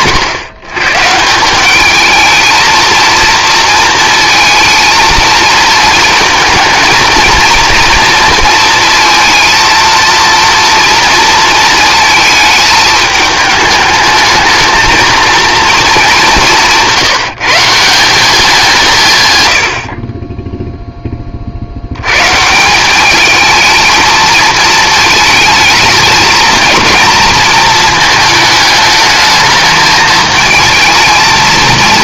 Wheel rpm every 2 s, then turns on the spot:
140, 230, 230, 230, 230, 230, 210, 220, 170, 190, 0, 180, 220, 230, 220, 220.
none